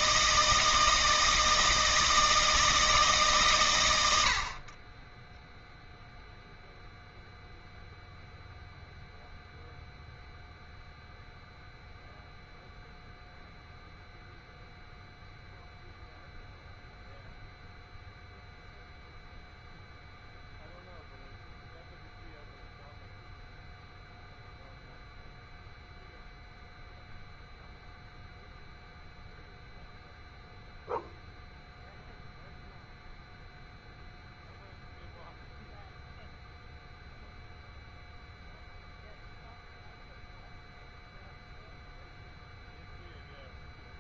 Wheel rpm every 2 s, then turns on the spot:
160, 160, 60, 0, 0, 0, 0, 0, 0, 0, 0, 0, 0, 0, 0, 0, 0, 0, 0, 0, 0, 0.
none